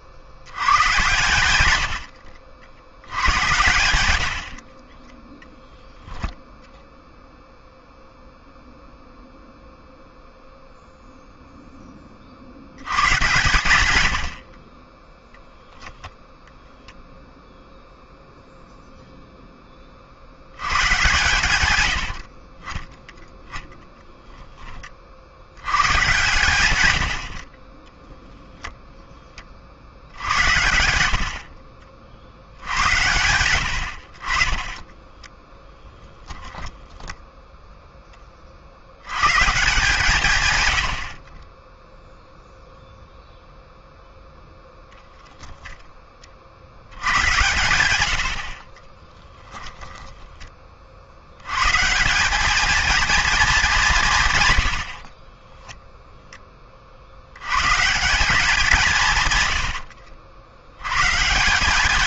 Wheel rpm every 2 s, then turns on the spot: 100, 80, 50, 0, 0, 0, 80, 20, 0, 0, 110, 40, 10, 110, 0, 80, 80, 20, 10, 50, 110, 0, 0, 70, 50, 20, 210, 100, 30, 180, 90.
30-32 36-38